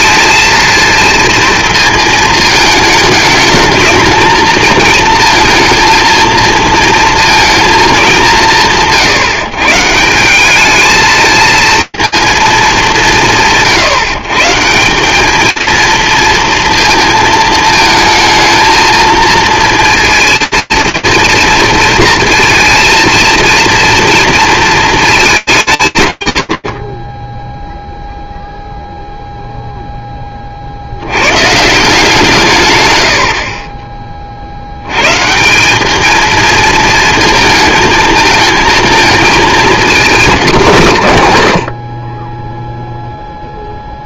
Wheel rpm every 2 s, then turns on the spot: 230, 220, 230, 230, 150, 220, 200, 170, 230, 230, 230, 230, 220, 50, 0, 110, 80, 150, 220, 220, 130, 0.
none